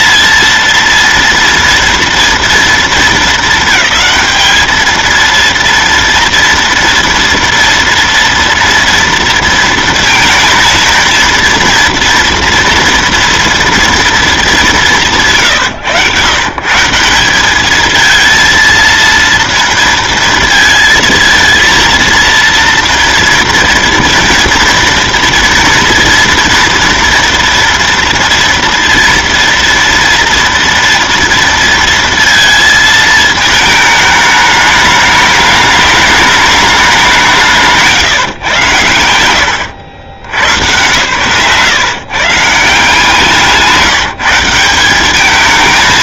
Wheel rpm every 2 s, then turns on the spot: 220, 230, 220, 230, 230, 230, 230, 220, 130, 220, 230, 230, 230, 230, 230, 230, 230, 210, 210, 150, 100, 150, 170.
none